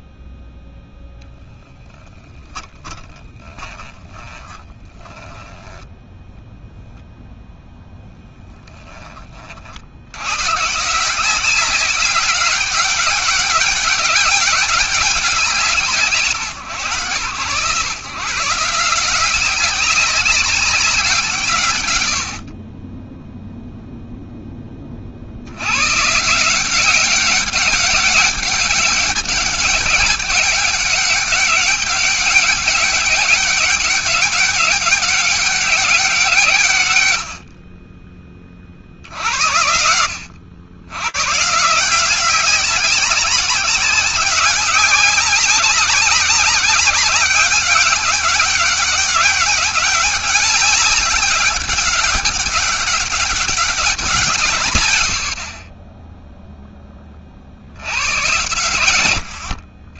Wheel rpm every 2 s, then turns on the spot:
0, 10, 20, 0, 20, 170, 200, 190, 120, 170, 180, 20, 50, 190, 200, 200, 200, 190, 70, 70, 140, 190, 190, 190, 200, 200, 200, 60, 30, 90.
2-6